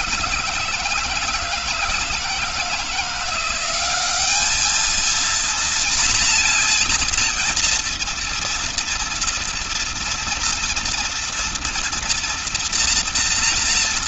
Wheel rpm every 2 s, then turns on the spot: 160, 170, 210, 240, 230, 230, 240.
none